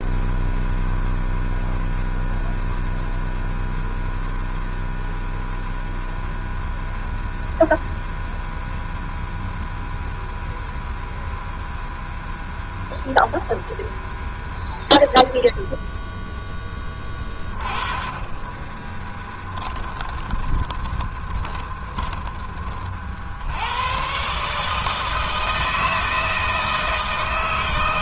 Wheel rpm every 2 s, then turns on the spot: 0, 0, 0, 0, 0, 0, 0, 0, 10, 20, 10, 30, 150, 160.
18-22